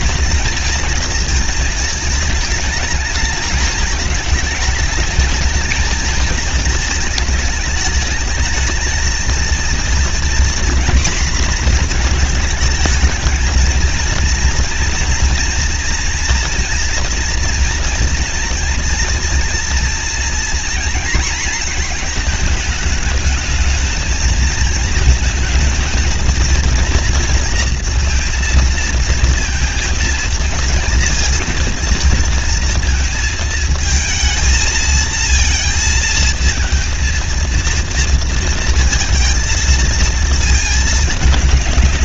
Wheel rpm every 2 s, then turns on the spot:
230, 220, 220, 220, 220, 240, 220, 230, 240, 230, 230, 220, 220, 230, 230, 230, 230, 220, 220, 230, 220.
none